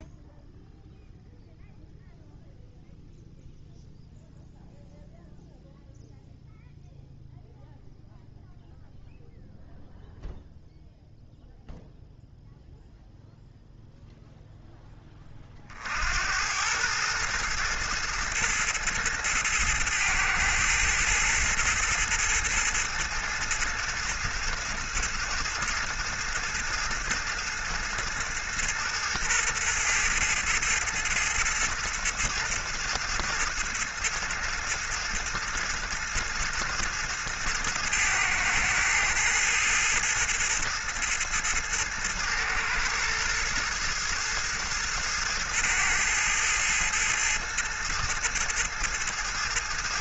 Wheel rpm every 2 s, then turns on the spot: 0, 0, 0, 0, 0, 0, 0, 10, 100, 110, 110, 110, 110, 110, 110, 110, 110, 110, 110, 110, 110, 110, 110, 110, 110.
none